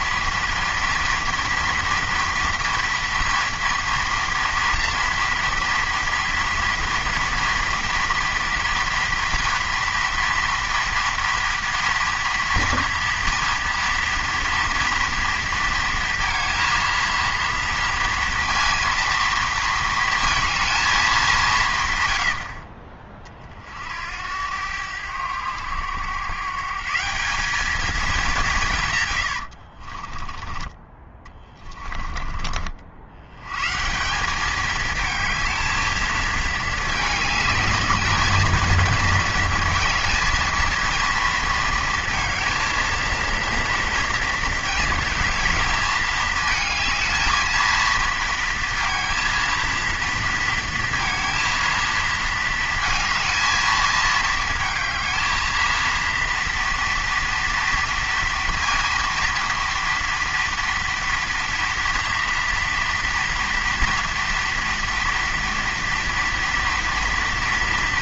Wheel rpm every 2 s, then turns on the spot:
230, 230, 230, 230, 230, 230, 230, 230, 230, 230, 230, 60, 90, 140, 160, 20, 50, 210, 220, 220, 230, 220, 230, 220, 230, 230, 230, 220, 230, 230, 230, 230, 230, 230.
22-24 30-32